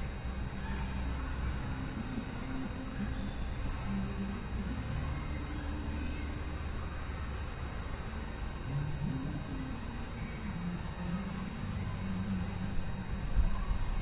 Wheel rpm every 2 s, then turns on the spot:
0, 0, 0, 0, 0, 0, 0.
none